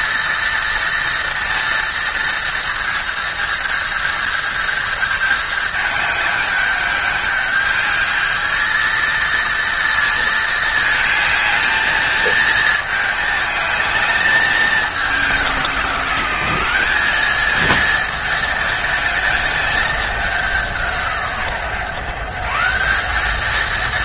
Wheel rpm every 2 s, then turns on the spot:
230, 230, 220, 210, 230, 220, 220, 200, 190, 220, 180, 180.
none